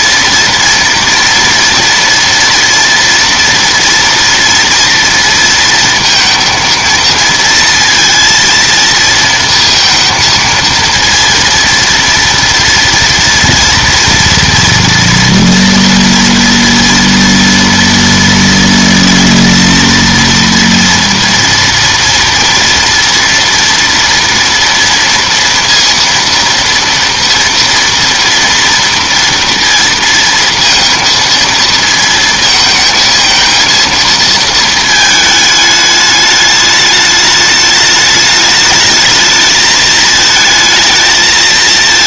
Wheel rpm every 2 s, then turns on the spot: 230, 230, 230, 230, 230, 230, 230, 230, 230, 230, 230, 230, 230, 230, 230, 230, 220, 220, 210, 210, 220.
none